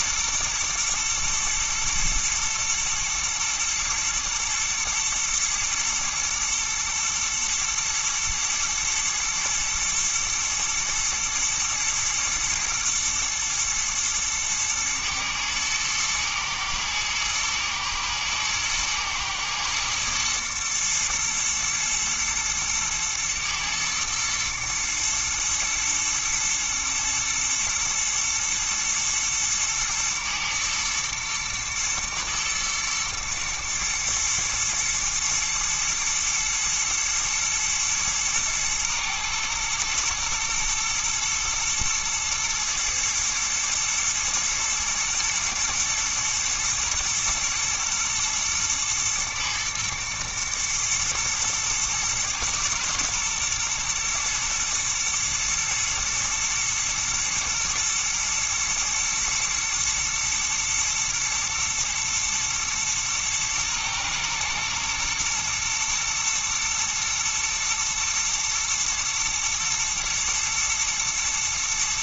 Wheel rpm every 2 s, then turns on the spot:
110, 110, 110, 110, 120, 110, 120, 110, 110, 120, 120, 110, 110, 120, 120, 110, 120, 110, 110, 120, 110, 110, 120, 120, 120, 110, 110, 110, 110, 110, 110, 120, 110, 110, 110, 110.
none